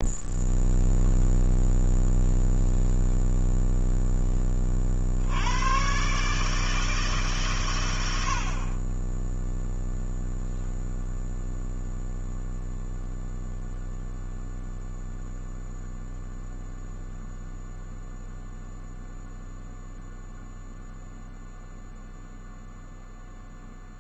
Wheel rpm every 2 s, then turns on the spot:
0, 0, 10, 140, 70, 0, 0, 0, 0, 0, 0, 0.
none